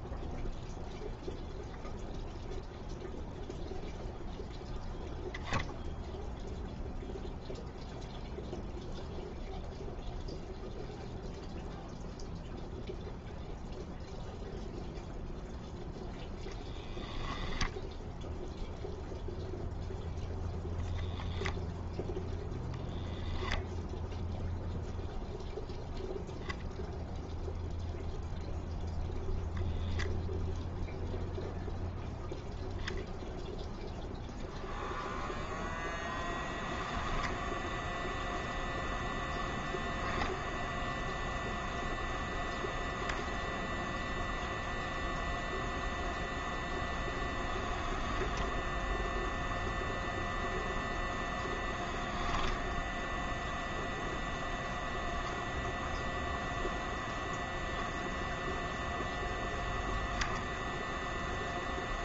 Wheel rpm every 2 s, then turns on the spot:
0, 0, 0, 0, 0, 0, 0, 0, 10, 0, 0, 0, 0, 0, 0, 0, 0, 0, 10, 0, 0, 0, 0, 10, 0, 0, 0, 0, 0, 0, 0.
16-18